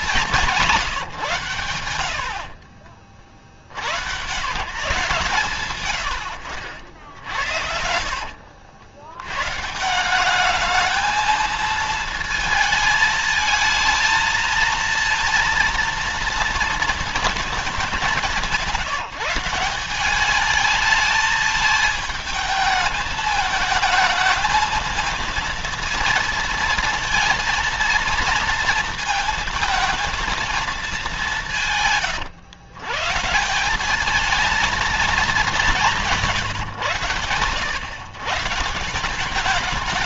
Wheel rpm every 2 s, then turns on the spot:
150, 40, 140, 70, 90, 220, 220, 230, 230, 170, 220, 220, 220, 230, 230, 210, 120, 220, 120, 160.
6-8